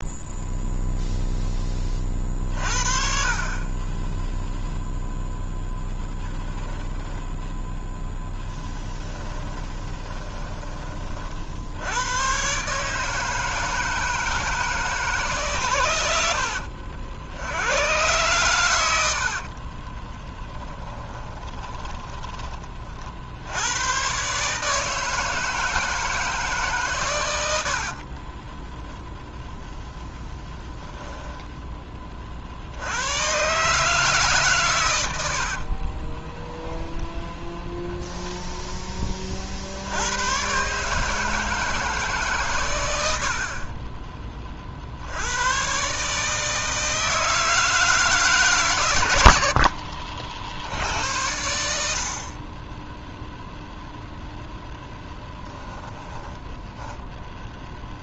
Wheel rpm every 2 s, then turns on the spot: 0, 40, 0, 0, 10, 20, 140, 160, 70, 90, 10, 30, 150, 140, 0, 10, 90, 110, 0, 10, 140, 110, 50, 160, 130, 70, 20, 0, 20.
8-10 20-22 56-58